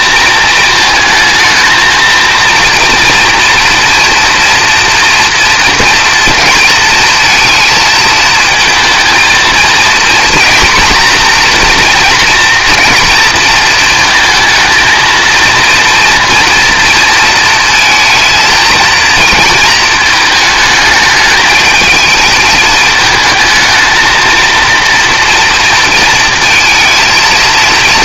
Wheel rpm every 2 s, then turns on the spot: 220, 230, 230, 220, 220, 240, 230, 230, 230, 230, 220, 220, 230, 230.
none